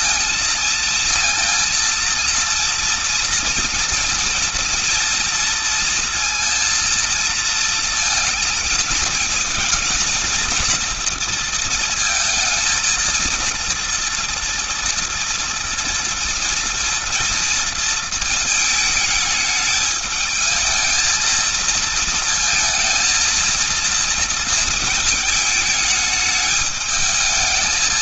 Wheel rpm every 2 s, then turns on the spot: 230, 230, 240, 230, 220, 230, 230, 230, 230, 220, 220, 220, 230, 220.
none